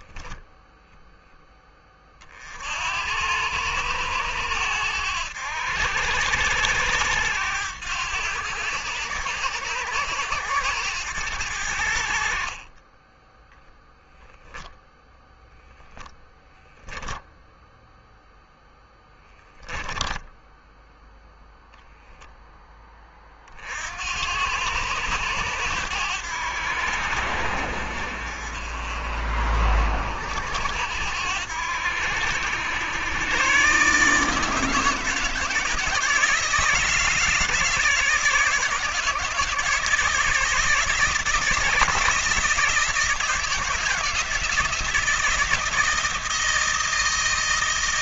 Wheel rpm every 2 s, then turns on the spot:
0, 70, 90, 90, 100, 100, 40, 0, 0, 0, 10, 10, 90, 70, 50, 80, 90, 150, 160, 150, 160, 160, 170, 170.
20-22